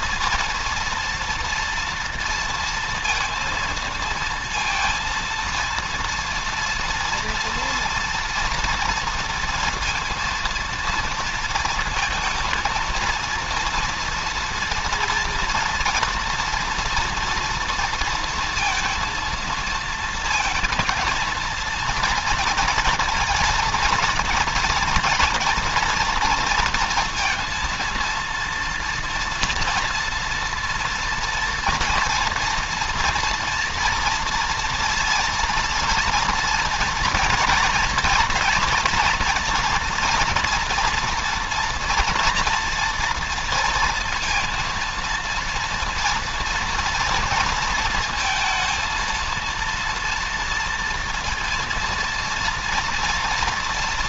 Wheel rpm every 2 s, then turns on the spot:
230, 230, 230, 230, 230, 230, 230, 230, 230, 230, 230, 230, 230, 230, 230, 230, 240, 230, 230, 230, 240, 230, 230, 240, 230, 230, 230.
none